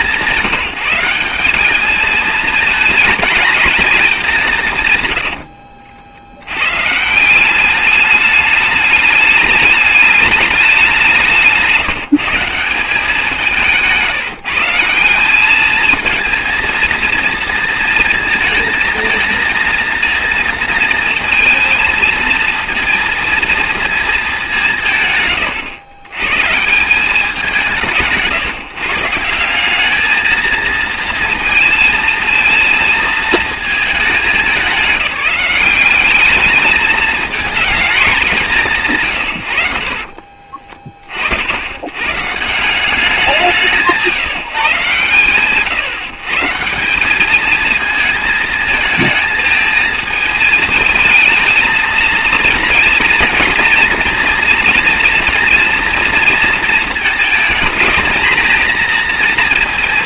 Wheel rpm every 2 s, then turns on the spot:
170, 220, 160, 130, 210, 200, 180, 160, 230, 230, 230, 230, 160, 170, 160, 220, 230, 200, 210, 170, 40, 180, 130, 170, 220, 220, 230, 230, 230, 230.
none